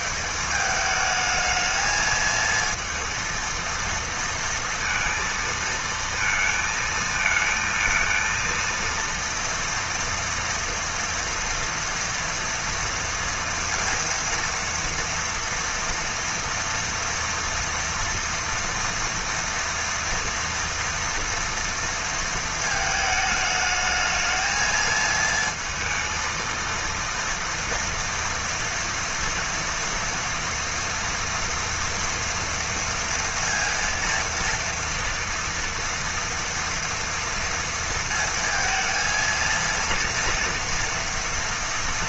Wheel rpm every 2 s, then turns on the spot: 210, 230, 230, 230, 230, 230, 230, 230, 230, 240, 230, 220, 220, 230, 230, 230, 230, 230, 240, 230, 230.
none